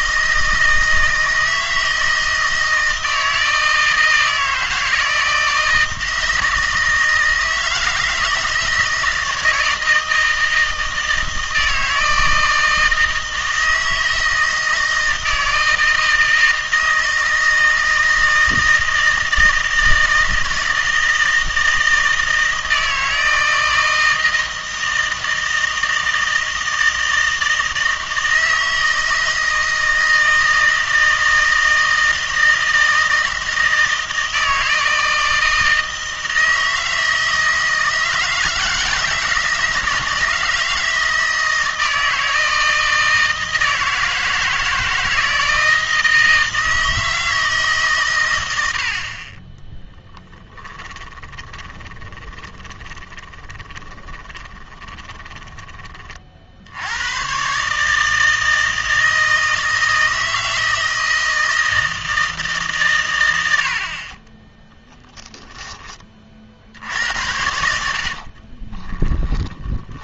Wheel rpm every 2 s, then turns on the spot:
160, 160, 160, 160, 160, 160, 160, 160, 160, 160, 160, 160, 160, 160, 160, 160, 160, 160, 160, 160, 160, 160, 160, 160, 90, 10, 20, 20, 70, 160, 160, 140, 10, 60, 30.
50-56 68-70